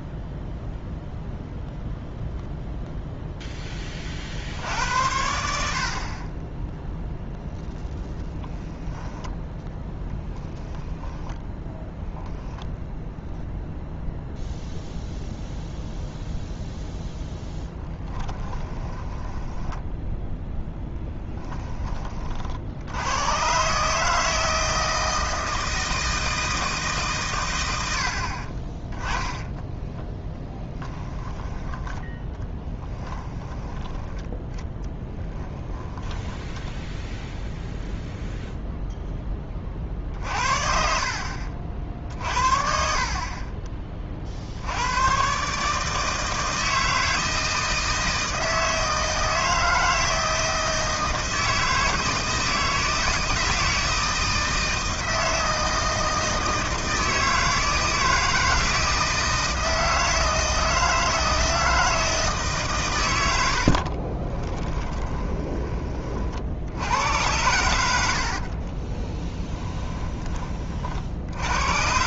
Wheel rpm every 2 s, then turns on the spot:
0, 0, 80, 10, 10, 10, 0, 0, 0, 10, 10, 80, 160, 150, 30, 10, 10, 10, 0, 0, 50, 50, 90, 160, 160, 160, 160, 160, 160, 160, 160, 120, 20, 80, 30, 50.
8-12 18-22 30-36 64-66 68-70